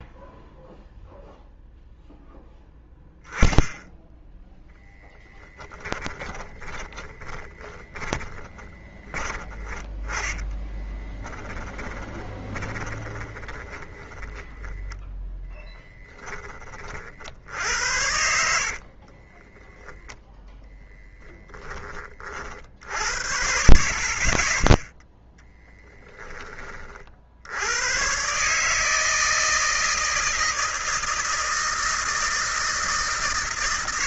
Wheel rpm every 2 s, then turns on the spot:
0, 0, 10, 20, 30, 20, 20, 20, 10, 60, 0, 40, 30, 30, 130, 160, 160.
6-16 18-20 26-28